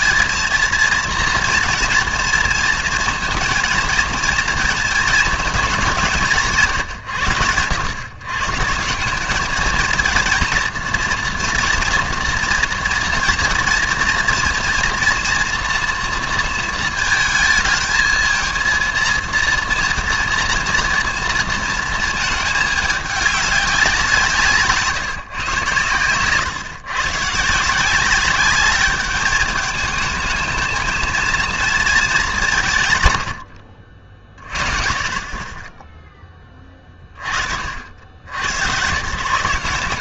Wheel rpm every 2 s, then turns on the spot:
230, 230, 230, 160, 140, 230, 230, 230, 230, 230, 230, 220, 160, 130, 200, 220, 170, 40, 20, 100.
none